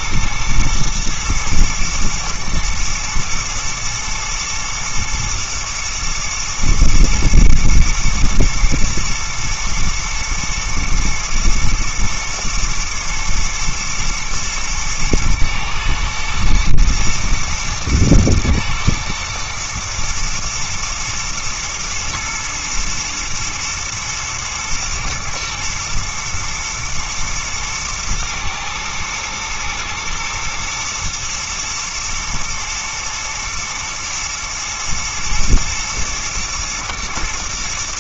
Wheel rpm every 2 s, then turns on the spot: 120, 110, 120, 120, 120, 110, 120, 110, 110, 120, 120, 110, 110, 120, 110, 110, 120, 120, 110.
none